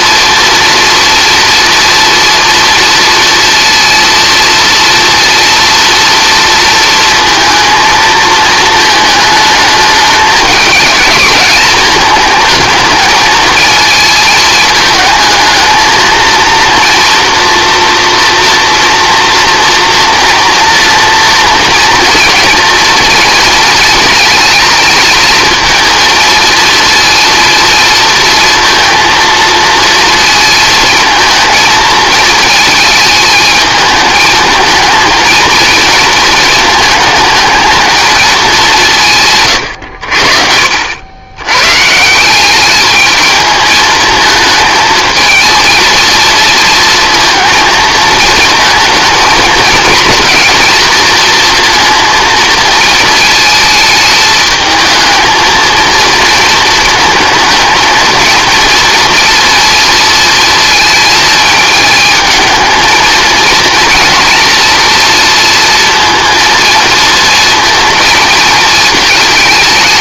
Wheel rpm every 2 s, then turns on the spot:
240, 240, 230, 230, 220, 210, 220, 220, 240, 230, 230, 230, 230, 230, 230, 230, 220, 220, 220, 170, 70, 210, 220, 230, 230, 230, 230, 220, 220, 230, 230, 220, 230, 230, 220.
none